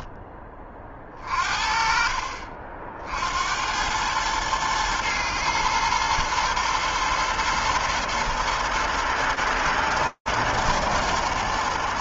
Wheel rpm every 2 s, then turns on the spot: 10, 50, 110, 110, 120, 110.
none